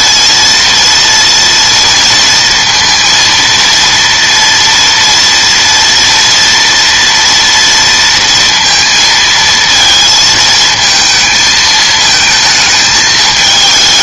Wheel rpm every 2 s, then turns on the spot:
230, 230, 230, 230, 230, 220, 220.
none